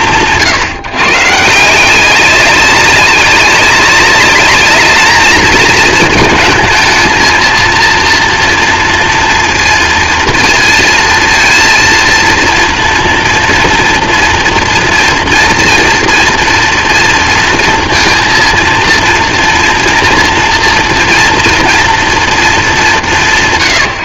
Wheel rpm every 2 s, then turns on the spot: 150, 190, 210, 230, 230, 230, 230, 230, 240, 230, 230, 160.
none